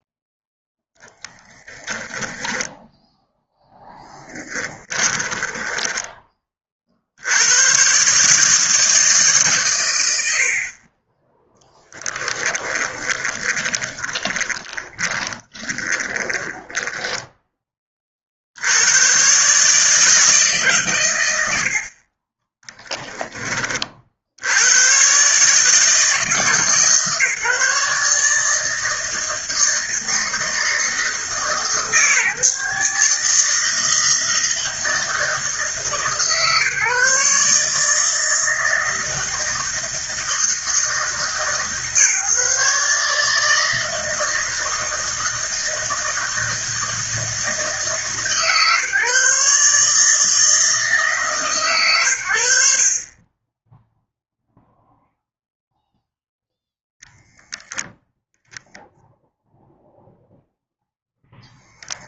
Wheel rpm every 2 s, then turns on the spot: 10, 0, 10, 60, 160, 40, 30, 20, 10, 110, 120, 20, 110, 150, 160, 160, 150, 160, 150, 160, 150, 150, 160, 160, 150, 150, 40, 0, 0, 0, 0.
4-6 12-16